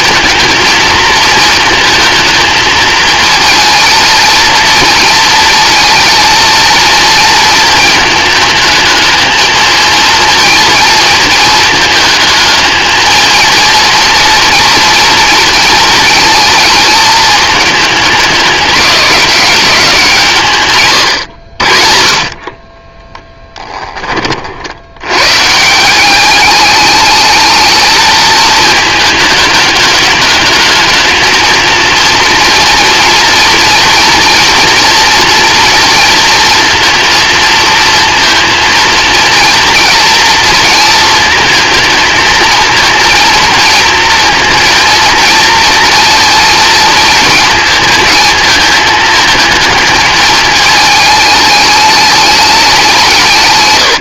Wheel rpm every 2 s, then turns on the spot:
220, 220, 230, 230, 220, 230, 220, 230, 220, 200, 130, 10, 90, 210, 210, 210, 230, 230, 230, 230, 230, 230, 230, 230, 220, 220, 180.
22-24